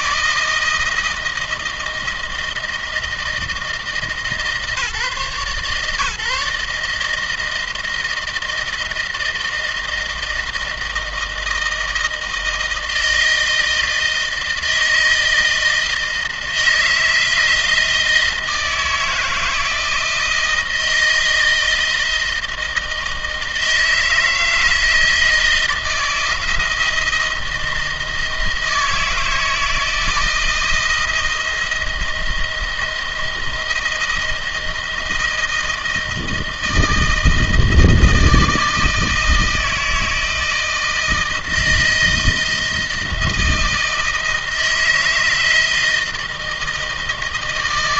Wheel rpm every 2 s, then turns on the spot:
160, 160, 140, 150, 170, 160, 160, 160, 160, 160, 160, 160, 160, 160, 160, 160, 160, 160, 160, 160, 160, 160, 160, 160.
none